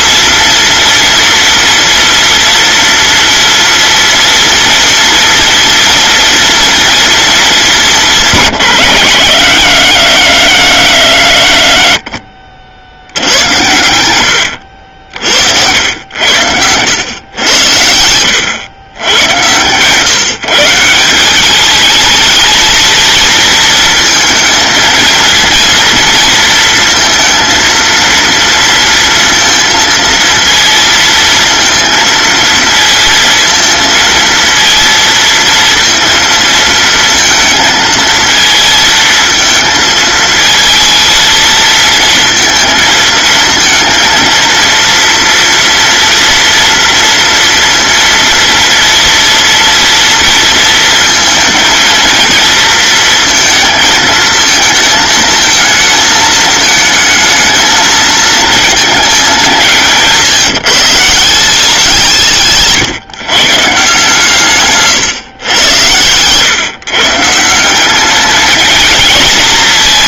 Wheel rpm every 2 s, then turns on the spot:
230, 230, 230, 230, 150, 90, 60, 90, 100, 110, 160, 220, 230, 230, 230, 230, 230, 230, 230, 230, 230, 220, 230, 230, 230, 230, 230, 220, 220, 230, 160, 140, 140, 140, 220.
14-16